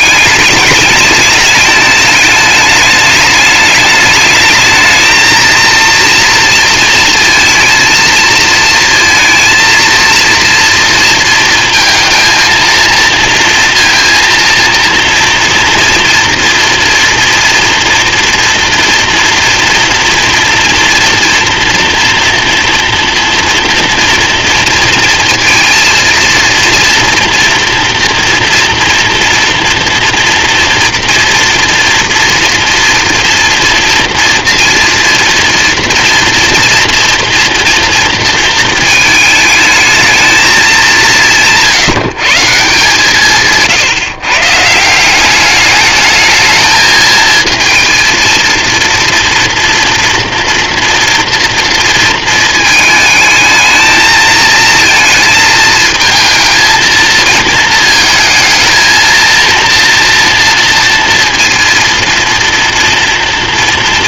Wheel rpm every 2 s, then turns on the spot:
210, 210, 220, 230, 230, 230, 230, 230, 230, 230, 230, 230, 230, 230, 230, 240, 230, 230, 230, 220, 180, 150, 180, 220, 240, 230, 220, 220, 220, 230, 230, 230.
none